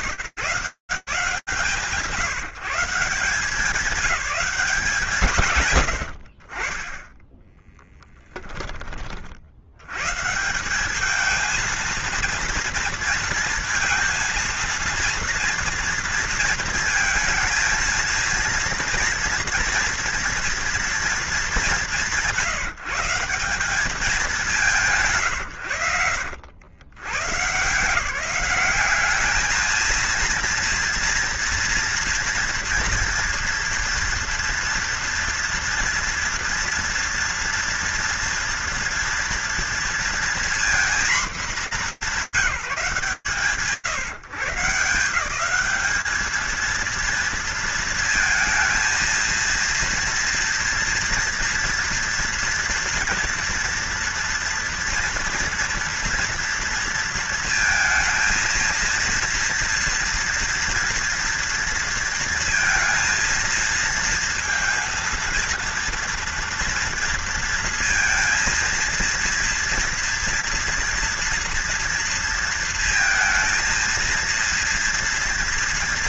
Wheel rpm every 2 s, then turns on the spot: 120, 180, 160, 10, 60, 220, 230, 230, 220, 230, 190, 180, 140, 160, 220, 230, 230, 230, 230, 230, 220, 160, 170, 220, 230, 230, 230, 230, 230, 230, 230, 230, 230, 230, 230, 230, 230, 230.
none